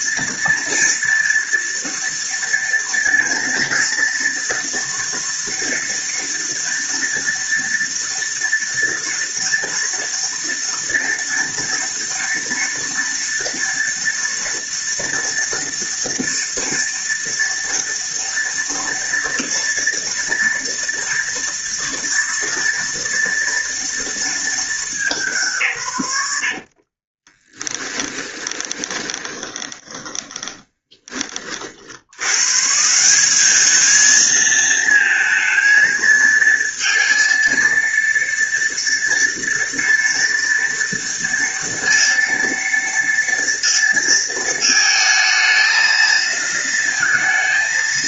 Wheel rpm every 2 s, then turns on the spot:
230, 230, 240, 240, 230, 230, 230, 230, 230, 230, 230, 230, 210, 60, 20, 30, 130, 220, 230, 230, 230, 230, 220, 230.
26-32